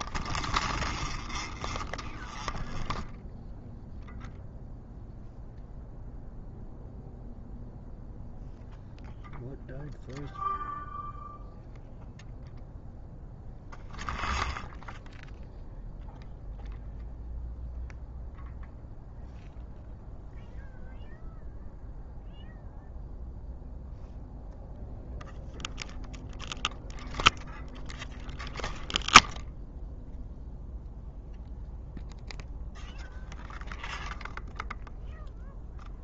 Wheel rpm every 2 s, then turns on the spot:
0, 0, 0, 0, 0, 0, 0, 0, 0, 0, 0, 0, 0, 0, 0, 0, 0, 0.
none